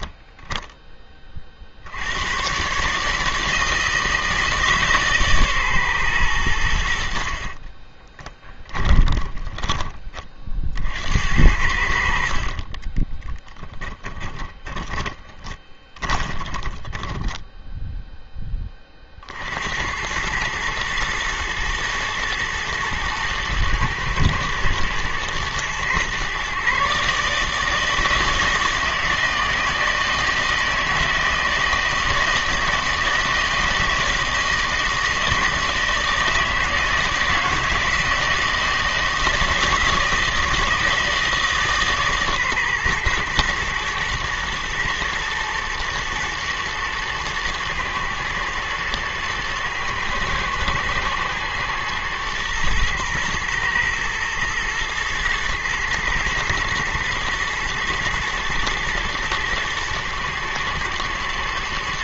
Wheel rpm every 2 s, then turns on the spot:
70, 160, 130, 30, 20, 70, 10, 20, 10, 60, 110, 110, 110, 150, 160, 160, 160, 160, 160, 160, 150, 120, 120, 110, 110, 110, 120, 110, 110, 120, 120.
6-10 12-18